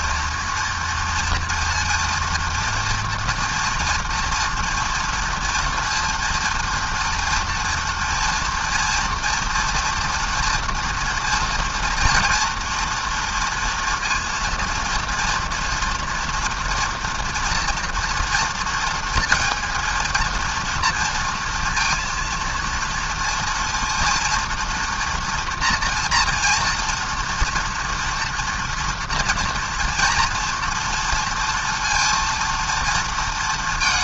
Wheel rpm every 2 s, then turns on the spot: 230, 230, 230, 230, 230, 240, 230, 230, 240, 230, 230, 230, 230, 230, 230, 230, 230.
none